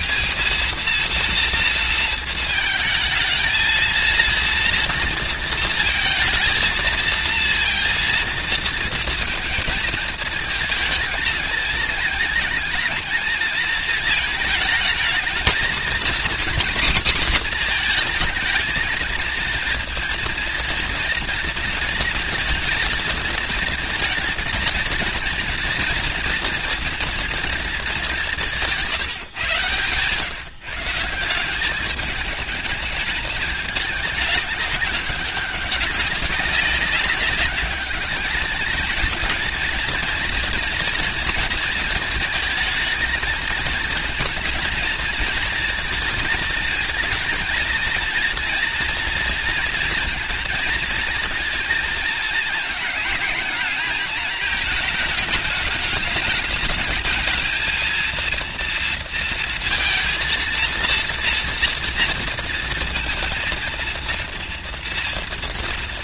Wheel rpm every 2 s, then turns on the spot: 200, 230, 230, 230, 230, 220, 230, 220, 250, 220, 230, 220, 230, 230, 190, 150, 210, 210, 190, 210, 230, 220, 220, 230, 230, 230, 220, 220, 210, 230, 230, 230, 230.
none